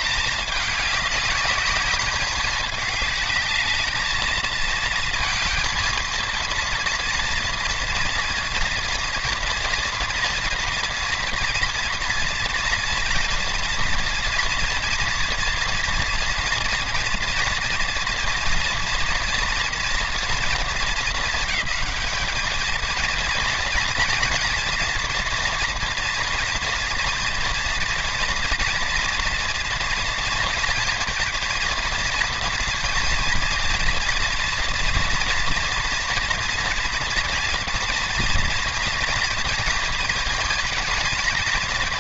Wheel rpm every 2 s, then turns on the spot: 200, 210, 220, 230, 230, 230, 230, 230, 230, 230, 230, 230, 240, 230, 230, 230, 230, 230, 230, 230, 230.
none